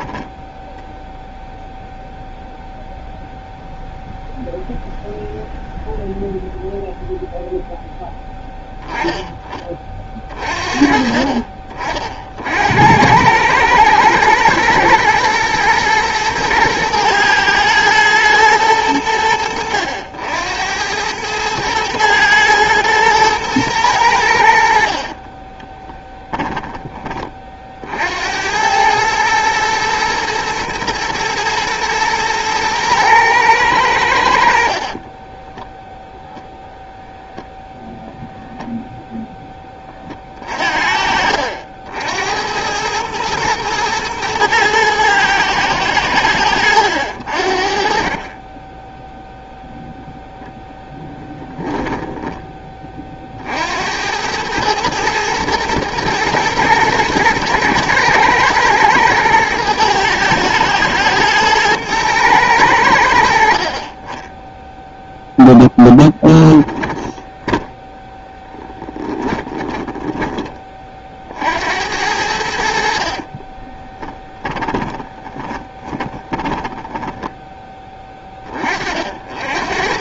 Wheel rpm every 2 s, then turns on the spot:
0, 0, 0, 0, 10, 40, 80, 110, 110, 100, 100, 110, 60, 20, 100, 120, 110, 60, 0, 0, 50, 100, 110, 80, 10, 0, 20, 110, 110, 110, 110, 90, 0, 10, 10, 30, 60, 20, 20, 30.
34-36 66-70 74-78